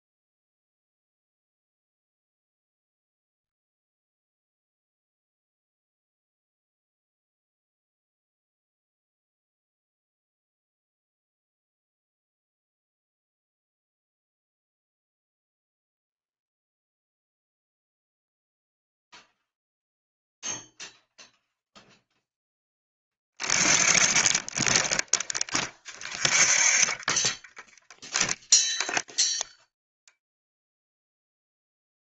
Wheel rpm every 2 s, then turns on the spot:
0, 0, 0, 0, 0, 0, 0, 0, 0, 0, 0, 0, 0, 0, 0, 0.
none